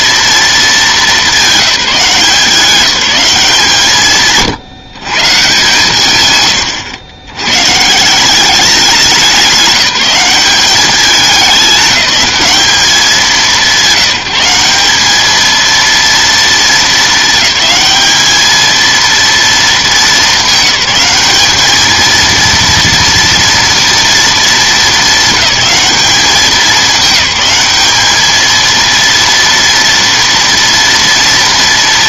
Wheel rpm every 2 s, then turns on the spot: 220, 190, 150, 120, 190, 190, 190, 190, 220, 220, 200, 230, 220, 200, 230, 230.
none